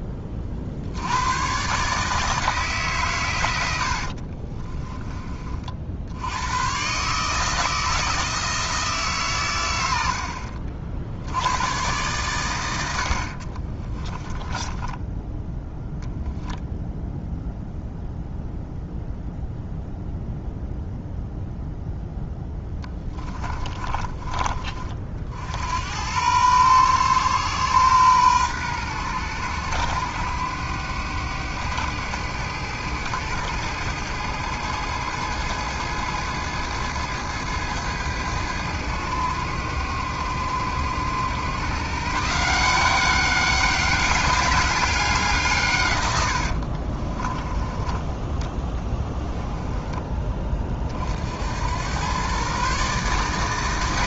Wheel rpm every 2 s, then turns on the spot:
80, 140, 20, 130, 160, 70, 80, 10, 0, 0, 0, 20, 50, 120, 110, 100, 100, 110, 110, 100, 100, 180, 190, 50, 20, 40, 140.
4-6 14-16 22-24 46-50